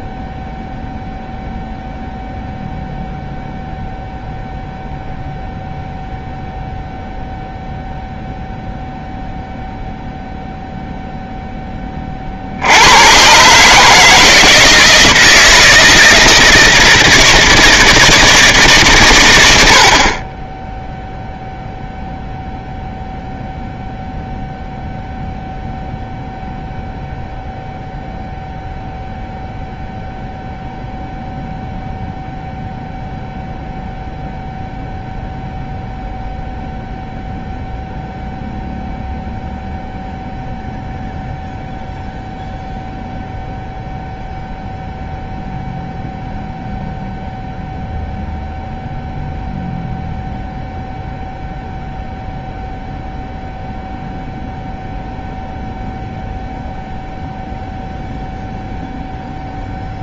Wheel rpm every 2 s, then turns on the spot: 0, 0, 0, 0, 0, 0, 70, 160, 160, 150, 10, 0, 0, 0, 0, 0, 0, 0, 0, 0, 0, 0, 0, 0, 0, 0, 0, 0, 0, 0.
none